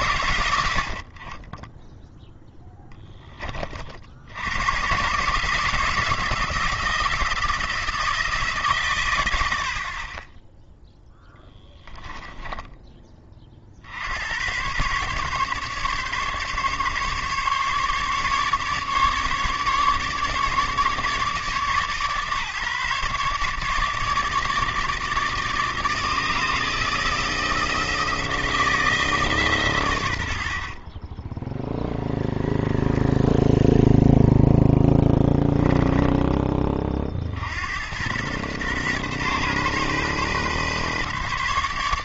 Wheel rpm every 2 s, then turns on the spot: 70, 10, 110, 160, 140, 0, 10, 120, 140, 150, 150, 140, 160, 160, 160, 40, 0, 10, 40, 130, 140.
30-32 34-36